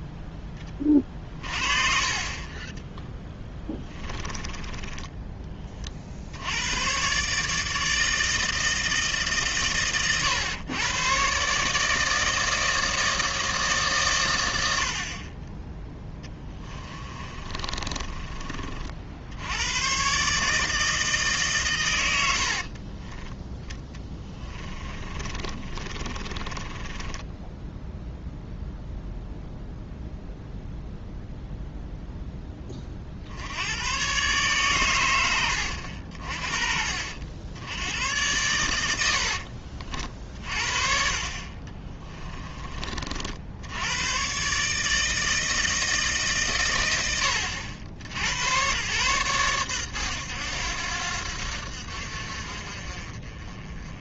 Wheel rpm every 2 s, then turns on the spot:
20, 20, 20, 90, 160, 110, 160, 80, 20, 40, 150, 50, 20, 20, 0, 0, 20, 130, 60, 90, 50, 30, 140, 110, 110, 90, 50.
4-6 16-18 22-28 40-42